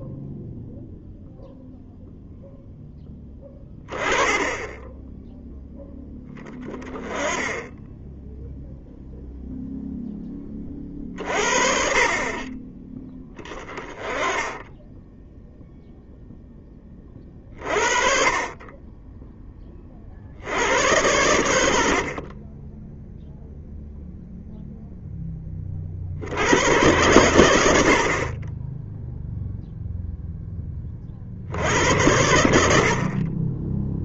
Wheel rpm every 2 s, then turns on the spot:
0, 0, 10, 10, 0, 30, 20, 10, 10, 20, 100, 10, 0, 110, 20, 20, 70.
none